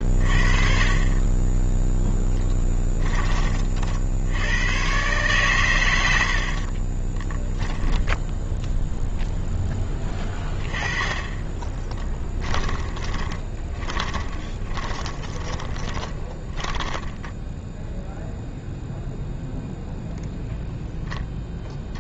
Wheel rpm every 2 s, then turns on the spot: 40, 10, 110, 50, 0, 20, 20, 30, 10, 0, 0.
6-8 12-18